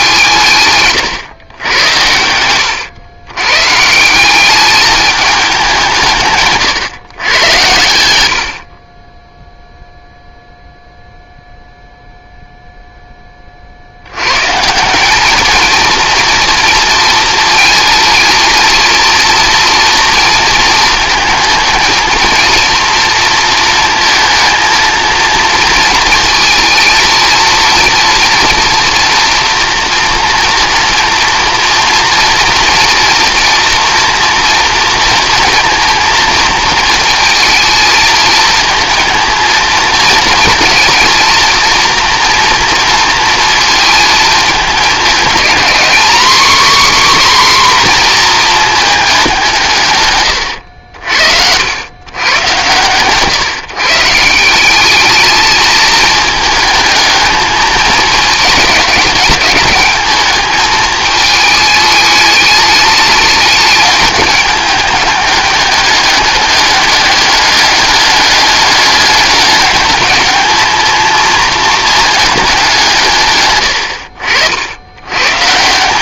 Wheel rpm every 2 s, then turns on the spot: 140, 100, 210, 140, 40, 0, 0, 170, 230, 230, 230, 230, 230, 230, 240, 230, 240, 230, 230, 220, 230, 230, 210, 270, 220, 80, 120, 200, 220, 200, 220, 210, 210, 200, 200, 220, 170, 90.
50-52